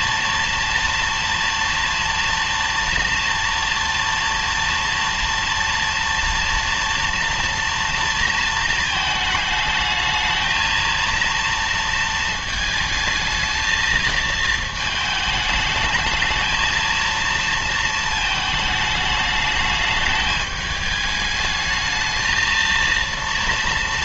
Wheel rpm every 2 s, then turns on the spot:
230, 230, 230, 240, 230, 230, 220, 220, 220, 220, 210, 220.
none